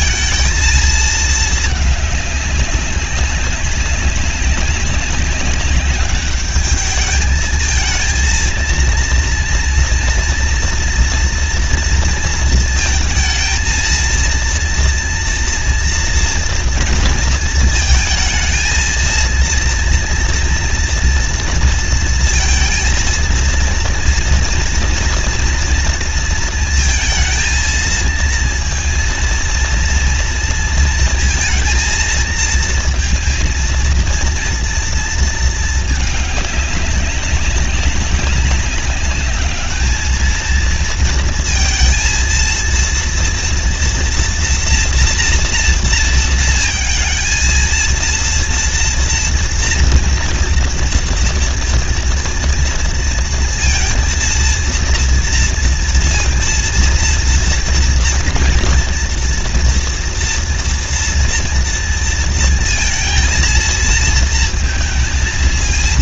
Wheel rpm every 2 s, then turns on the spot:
230, 200, 190, 200, 230, 240, 230, 230, 230, 230, 230, 230, 230, 230, 230, 230, 230, 230, 210, 200, 220, 230, 240, 230, 230, 230, 230, 230, 230, 230, 230, 230, 230.
none